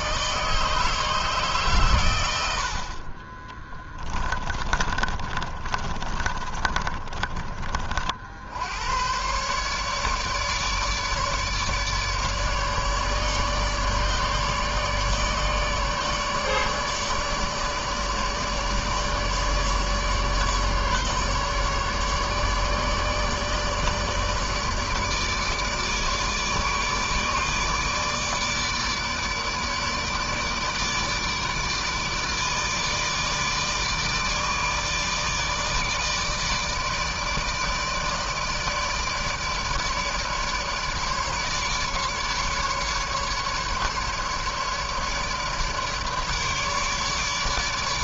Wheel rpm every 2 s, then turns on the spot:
160, 90, 20, 30, 80, 150, 150, 150, 150, 150, 150, 150, 150, 150, 150, 150, 160, 150, 160, 160, 150, 150, 150, 150.
4-8